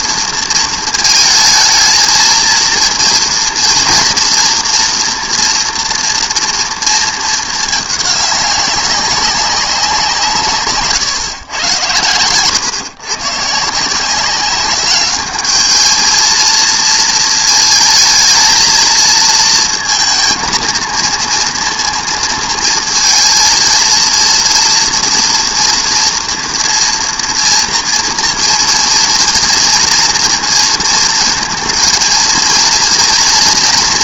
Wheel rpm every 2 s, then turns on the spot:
230, 230, 230, 230, 190, 140, 120, 200, 230, 220, 230, 230, 230, 230, 230, 230, 230.
10-12